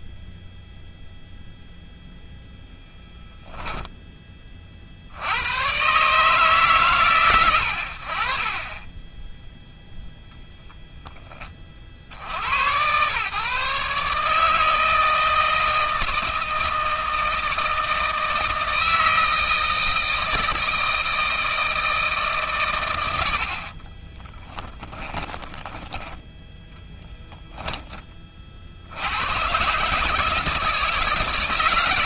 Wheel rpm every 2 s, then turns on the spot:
0, 0, 70, 130, 10, 10, 120, 160, 160, 160, 160, 100, 20, 10, 90, 160.
24-28